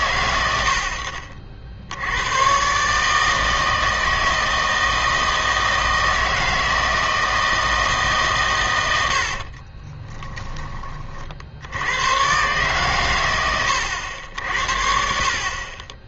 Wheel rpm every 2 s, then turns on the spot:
80, 130, 160, 160, 120, 20, 130, 60.
none